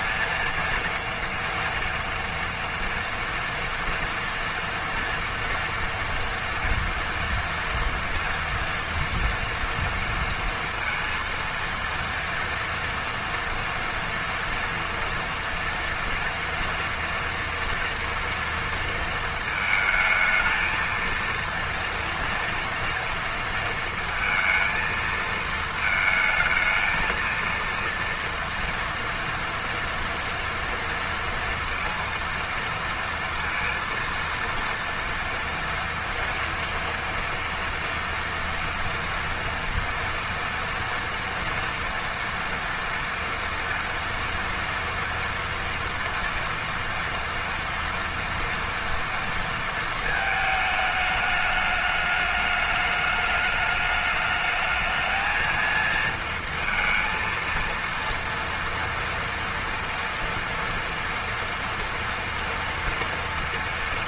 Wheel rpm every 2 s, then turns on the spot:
230, 230, 230, 230, 230, 230, 230, 240, 230, 230, 220, 230, 230, 220, 230, 230, 230, 230, 230, 230, 230, 230, 230, 230, 230, 220, 210, 220, 230, 230, 230, 240.
none